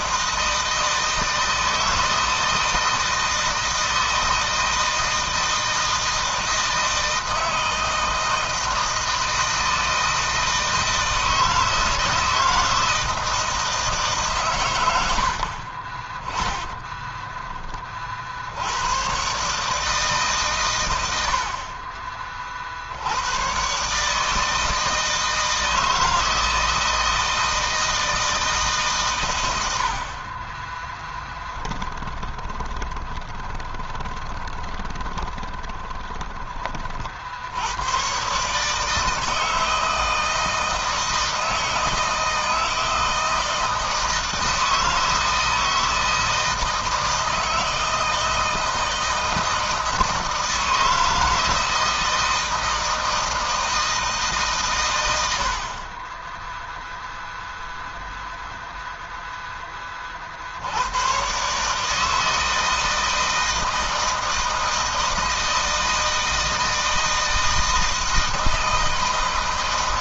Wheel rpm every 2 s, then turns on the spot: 160, 160, 160, 160, 160, 160, 160, 130, 30, 70, 130, 50, 160, 160, 160, 40, 20, 20, 30, 140, 160, 160, 160, 160, 160, 160, 160, 150, 20, 0, 60, 160, 160, 160, 160.
32-36